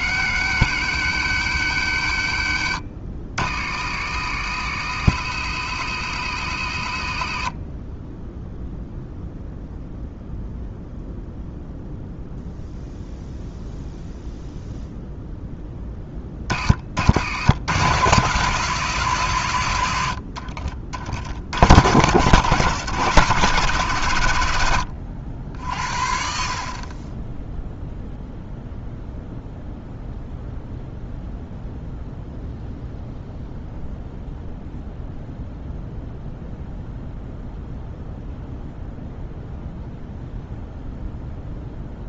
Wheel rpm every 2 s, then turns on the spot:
100, 60, 80, 60, 0, 0, 0, 0, 60, 140, 50, 120, 80, 20, 0, 0, 0, 0, 0, 0, 0.
none